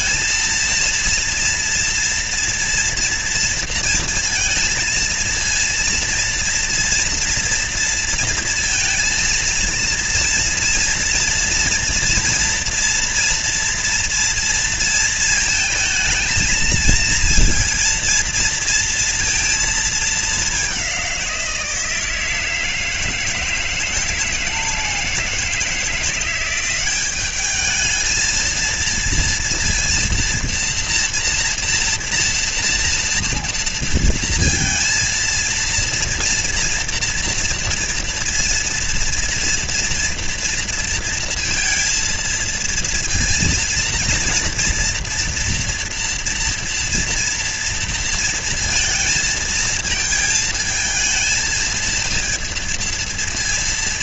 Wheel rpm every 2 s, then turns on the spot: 230, 230, 230, 230, 230, 230, 230, 230, 230, 230, 200, 160, 160, 180, 230, 240, 230, 230, 240, 240, 230, 230, 230, 230, 230, 220, 230.
none